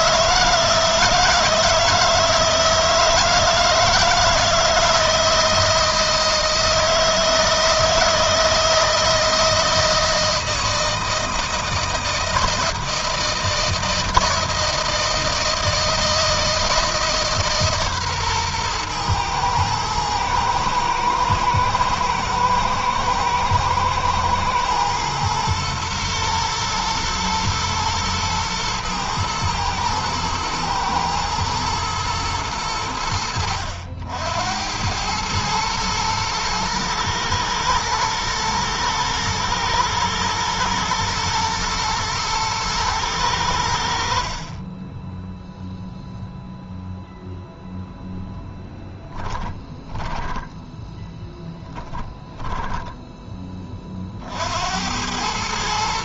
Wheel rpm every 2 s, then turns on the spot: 160, 160, 160, 160, 160, 160, 160, 160, 160, 120, 120, 110, 110, 120, 120, 110, 90, 100, 110, 110, 120, 110, 10, 0, 10, 10, 10, 90.
48-54